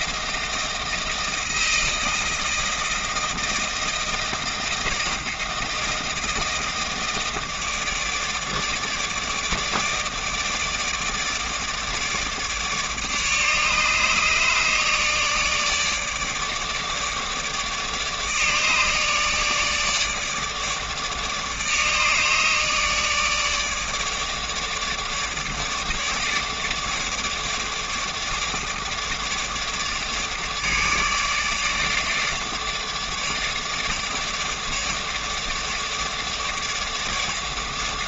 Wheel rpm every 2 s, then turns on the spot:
160, 160, 160, 160, 160, 160, 150, 150, 150, 150, 150, 150, 150, 150, 150, 160, 150, 150, 150.
none